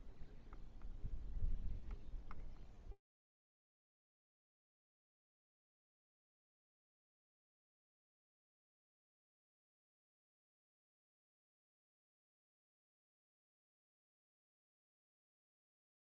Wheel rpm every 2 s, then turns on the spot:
0, 0, 0, 0, 0, 0, 0, 0.
none